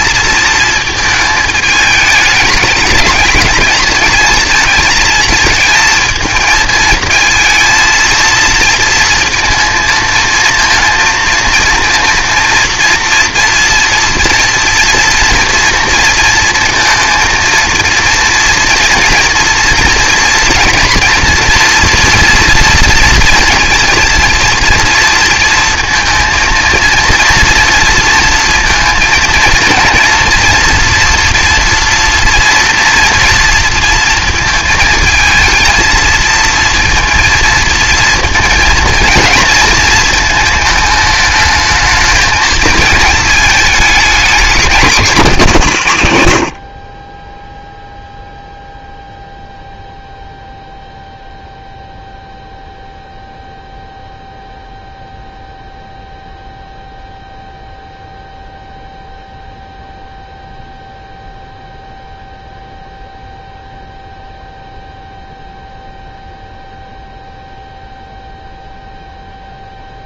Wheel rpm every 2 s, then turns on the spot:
220, 210, 220, 220, 230, 220, 230, 240, 220, 230, 230, 230, 230, 230, 230, 230, 230, 230, 230, 230, 220, 220, 210, 110, 0, 0, 0, 0, 0, 0, 0, 0, 0, 0, 0.
none